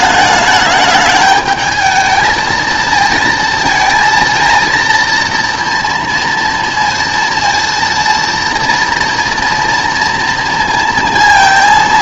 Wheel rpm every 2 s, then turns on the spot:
210, 220, 230, 230, 230, 230.
none